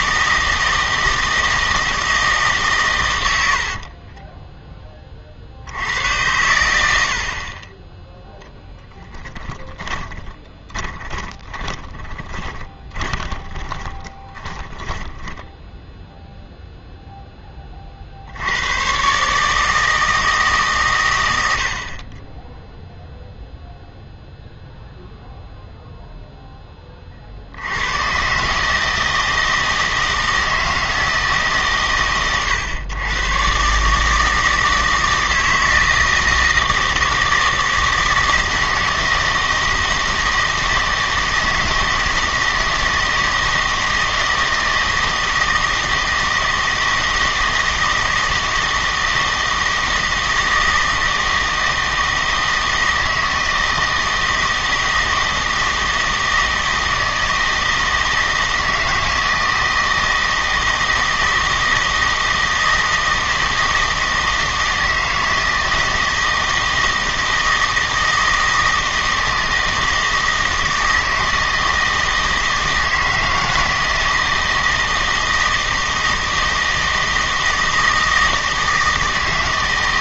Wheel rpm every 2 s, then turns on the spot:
160, 130, 10, 90, 10, 30, 20, 10, 0, 90, 140, 0, 0, 20, 150, 160, 110, 160, 160, 160, 160, 160, 160, 160, 160, 160, 160, 160, 160, 160, 160, 160, 160, 160, 160, 160, 160, 160, 160, 160.
8-16